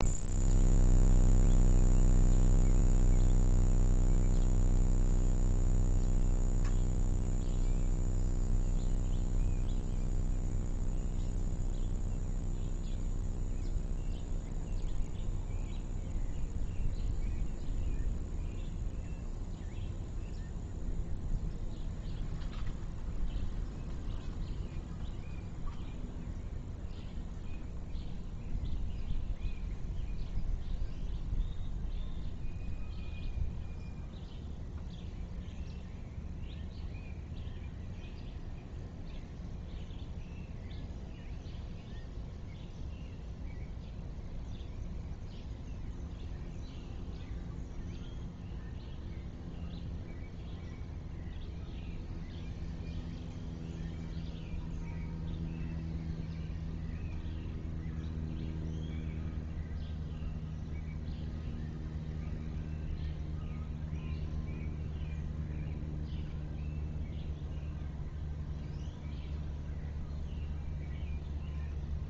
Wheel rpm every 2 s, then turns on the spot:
0, 0, 0, 0, 0, 0, 0, 0, 0, 0, 0, 0, 0, 0, 0, 0, 0, 0, 0, 0, 0, 0, 0, 0, 0, 0, 0, 0, 0, 0, 0, 0, 0, 0, 0, 0.
none